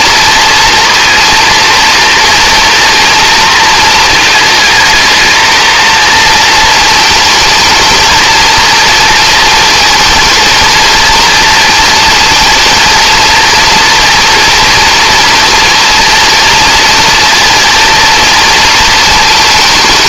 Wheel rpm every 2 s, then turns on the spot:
230, 230, 220, 220, 230, 230, 230, 230, 230, 220.
none